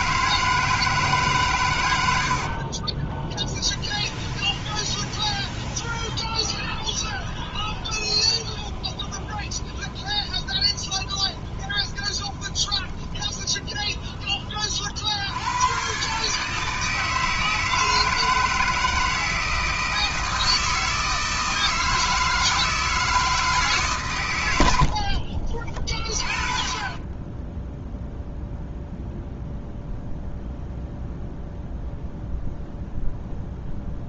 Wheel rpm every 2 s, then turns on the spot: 160, 30, 20, 10, 20, 20, 20, 50, 160, 160, 160, 160, 70, 20, 0, 0, 0.
2-14 24-26